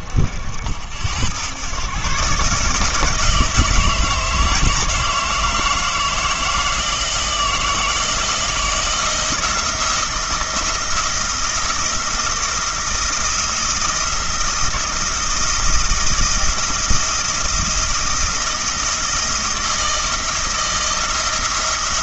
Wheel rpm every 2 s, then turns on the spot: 70, 150, 160, 160, 170, 170, 170, 170, 170, 170, 160.
none